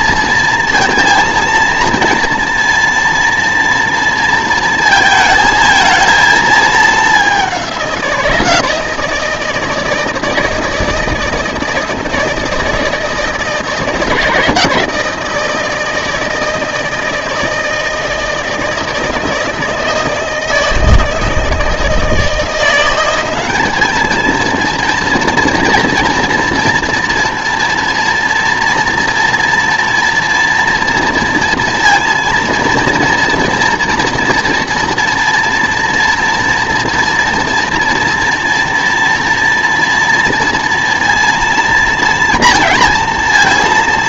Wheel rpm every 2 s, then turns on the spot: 230, 230, 230, 220, 160, 160, 160, 160, 160, 160, 160, 170, 230, 230, 230, 230, 230, 230, 230, 230, 230, 230.
none